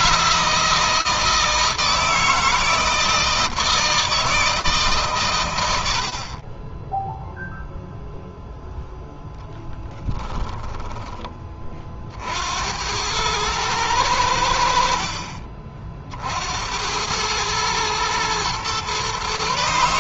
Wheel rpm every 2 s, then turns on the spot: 160, 160, 140, 0, 0, 20, 100, 50, 100, 130.
none